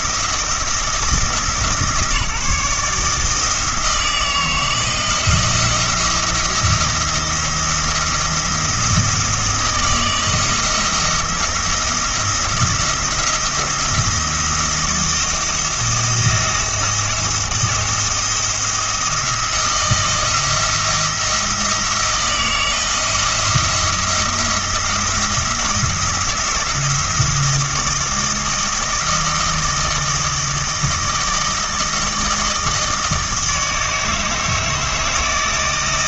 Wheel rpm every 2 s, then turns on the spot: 170, 160, 170, 170, 160, 160, 170, 170, 170, 170, 170, 170, 170, 170, 160, 160, 160, 160.
none